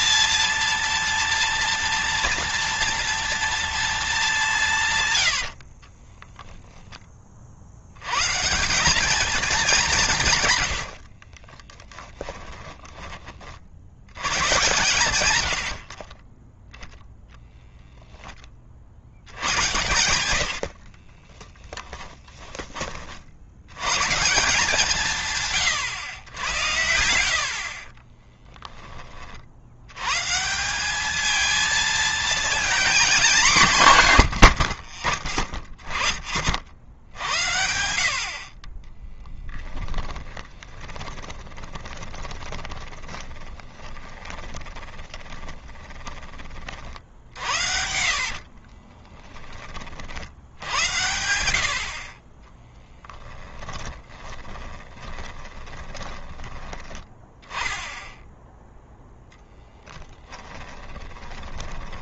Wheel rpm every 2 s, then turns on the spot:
230, 230, 190, 0, 150, 130, 10, 100, 10, 30, 60, 20, 170, 100, 20, 160, 230, 70, 40, 60, 20, 20, 20, 30, 40, 70, 30, 30, 20, 10, 20.
10-14 20-22 28-30 40-46 48-50 52-56 60-62